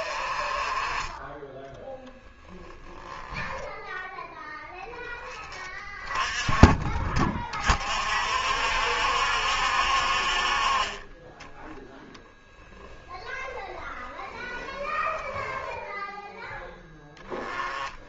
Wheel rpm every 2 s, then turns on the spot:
30, 0, 0, 30, 60, 40, 10, 10, 10.
14-16